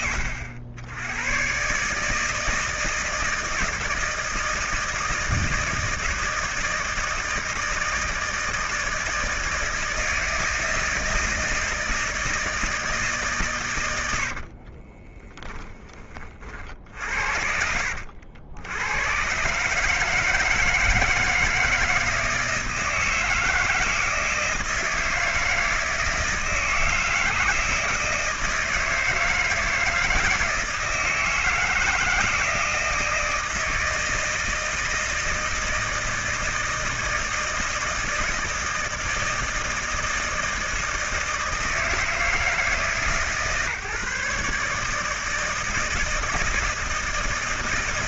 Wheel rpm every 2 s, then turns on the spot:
90, 160, 160, 160, 160, 160, 160, 40, 60, 100, 160, 160, 160, 160, 160, 160, 160, 160, 160, 160, 160, 150, 150, 160.
14-16